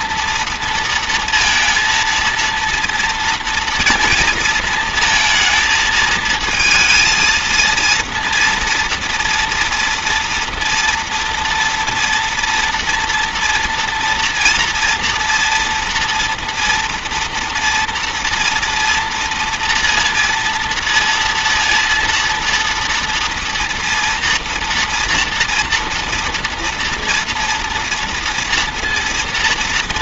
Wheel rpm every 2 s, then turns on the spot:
230, 230, 220, 230, 240, 230, 230, 240, 230, 230, 230, 230, 230, 230, 230.
none